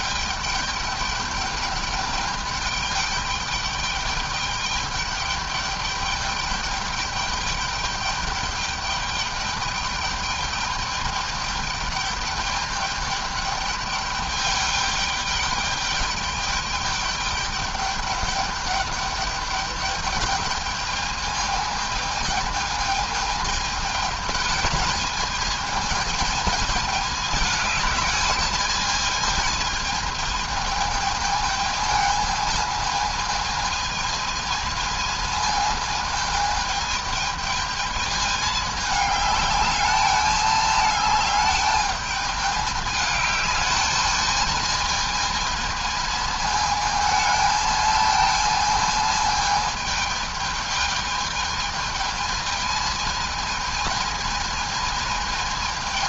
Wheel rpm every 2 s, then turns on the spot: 210, 210, 210, 210, 210, 210, 210, 210, 210, 210, 210, 220, 220, 210, 210, 220, 220, 220, 220, 210, 210, 210, 220, 220, 220, 220, 220, 220.
none